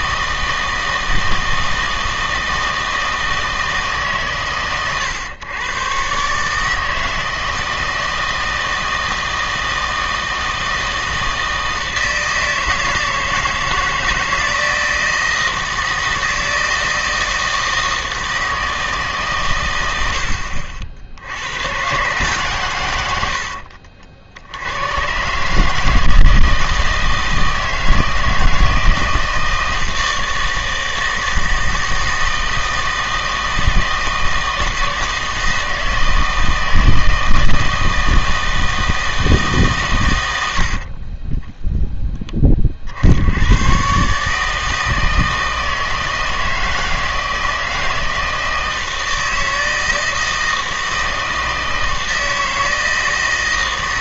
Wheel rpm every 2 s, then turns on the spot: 160, 160, 130, 150, 160, 160, 160, 160, 160, 160, 60, 120, 100, 160, 160, 160, 160, 160, 160, 160, 60, 40, 160, 160, 160, 160, 160.
none